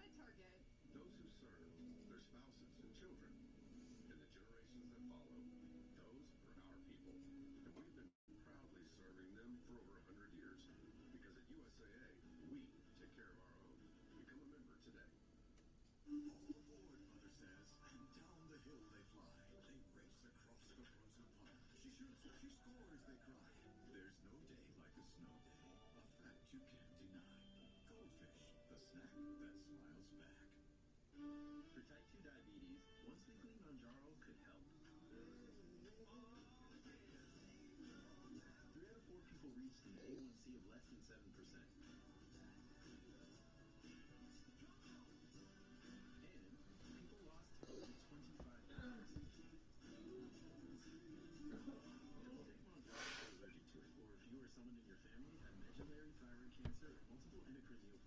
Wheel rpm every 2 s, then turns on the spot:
0, 0, 0, 0, 0, 0, 0, 0, 0, 0, 0, 0, 0, 0, 0, 0, 0, 0, 0, 0, 0, 0, 0, 0, 0, 0, 0, 0, 0.
none